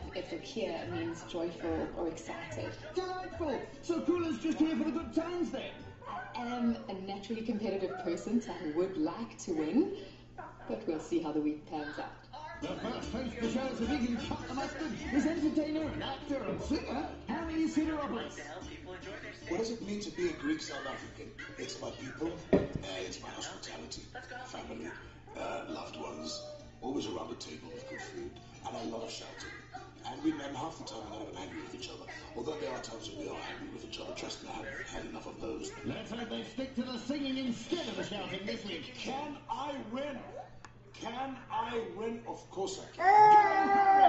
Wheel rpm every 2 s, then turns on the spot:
0, 0, 0, 0, 0, 0, 0, 0, 0, 0, 0, 0, 0, 0, 0, 0, 0, 0, 0, 0, 0, 0.
none